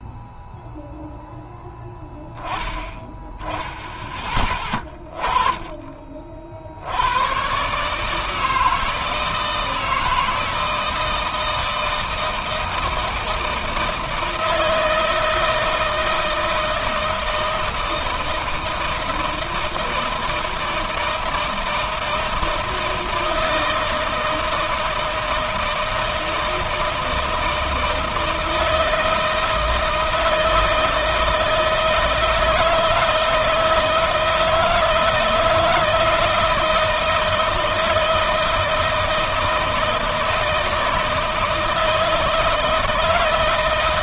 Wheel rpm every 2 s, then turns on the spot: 0, 0, 20, 90, 160, 160, 160, 160, 160, 160, 160, 160, 170, 160, 160, 160, 160, 160, 160, 160, 160, 160.
none